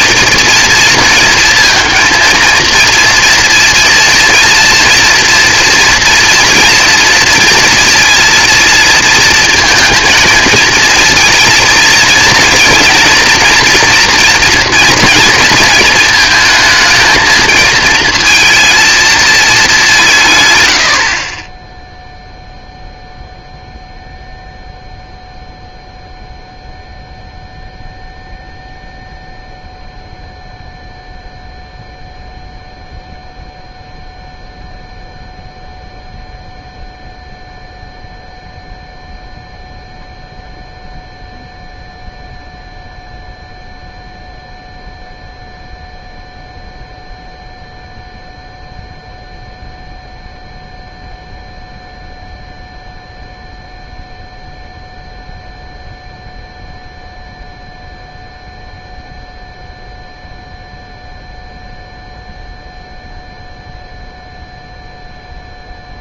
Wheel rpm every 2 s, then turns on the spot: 230, 230, 230, 240, 230, 220, 230, 240, 220, 230, 120, 0, 0, 0, 0, 0, 0, 0, 0, 0, 0, 0, 0, 0, 0, 0, 0, 0, 0, 0, 0, 0, 0.
none